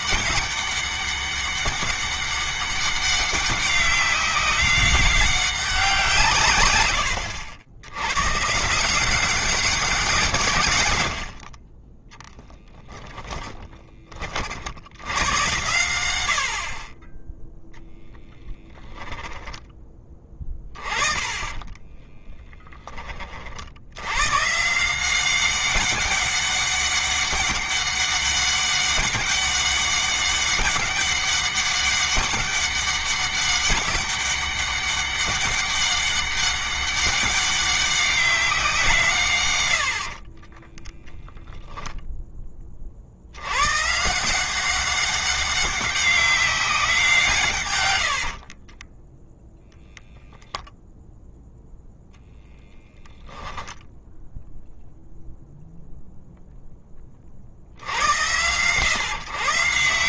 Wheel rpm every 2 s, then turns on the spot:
200, 200, 190, 100, 170, 120, 10, 90, 30, 10, 20, 20, 170, 200, 200, 200, 200, 200, 200, 160, 10, 60, 190, 180, 20, 0, 10, 0, 20, 130.
48-50